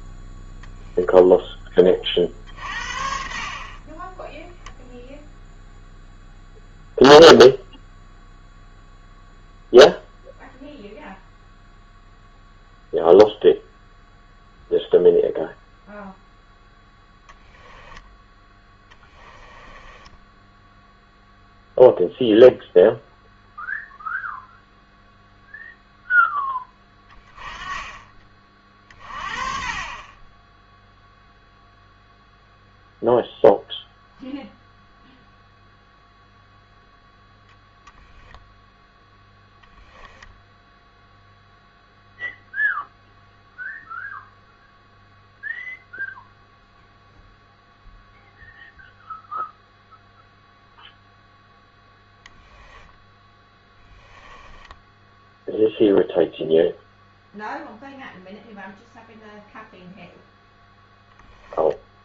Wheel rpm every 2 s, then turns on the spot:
0, 50, 0, 0, 0, 0, 0, 0, 10, 10, 0, 0, 0, 10, 30, 0, 0, 0, 10, 10, 0, 0, 0, 0, 0, 0, 0, 10, 0, 0, 0.
18-20 54-56